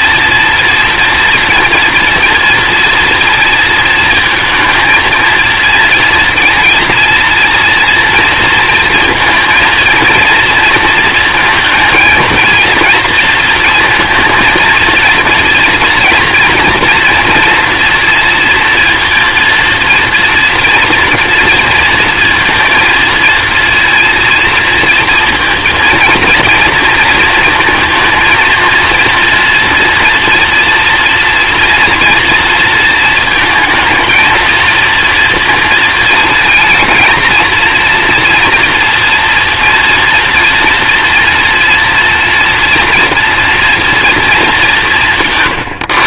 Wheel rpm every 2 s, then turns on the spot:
240, 230, 220, 230, 230, 230, 230, 230, 230, 230, 230, 230, 230, 230, 230, 230, 230, 230, 220, 240, 230, 240, 220.
none